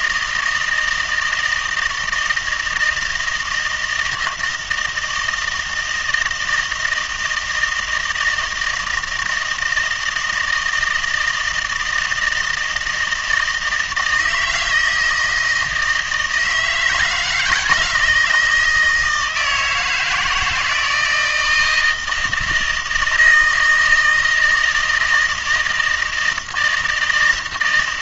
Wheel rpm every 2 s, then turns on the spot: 160, 160, 160, 160, 160, 160, 160, 160, 160, 160, 160, 160, 160, 170.
none